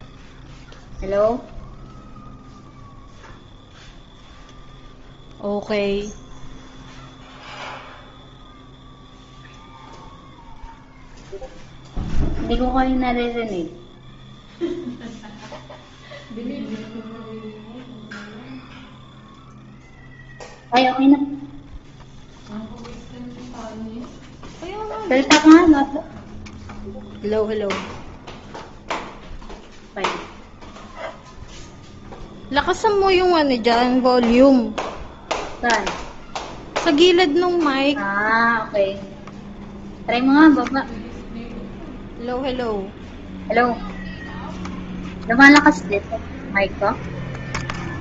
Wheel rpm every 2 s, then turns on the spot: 0, 0, 0, 0, 0, 0, 0, 0, 0, 0, 0, 0, 0, 0, 0, 0, 0, 0, 0, 0, 0, 0, 0, 0.
none